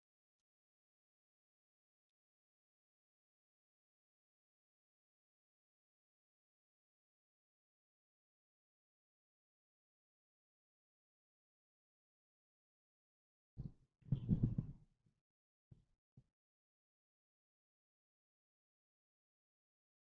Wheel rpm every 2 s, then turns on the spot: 0, 0, 0, 0, 0, 0, 0, 0, 0, 0.
none